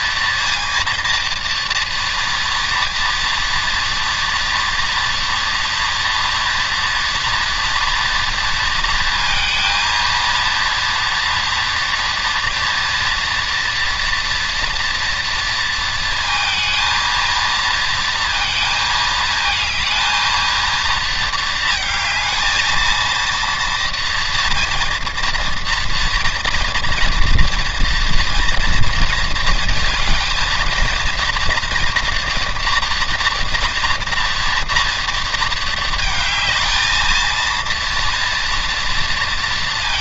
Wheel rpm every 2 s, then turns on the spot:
230, 230, 230, 230, 230, 230, 230, 240, 230, 220, 230, 230, 230, 230, 230, 230, 240, 230, 220, 230.
none